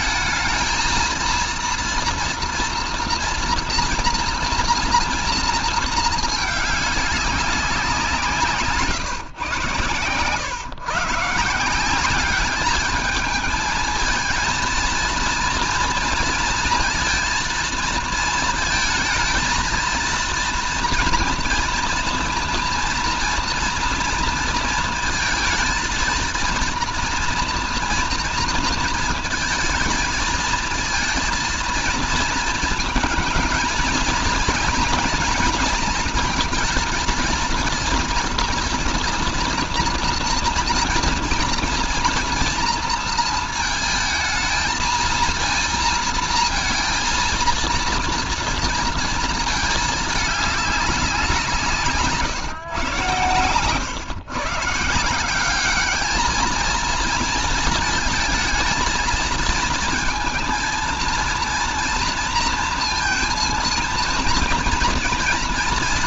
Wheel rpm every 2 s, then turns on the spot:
230, 230, 230, 210, 150, 140, 210, 230, 230, 230, 230, 240, 230, 230, 230, 230, 230, 230, 230, 230, 230, 240, 220, 230, 230, 210, 140, 150, 220, 230, 230, 230, 230.
none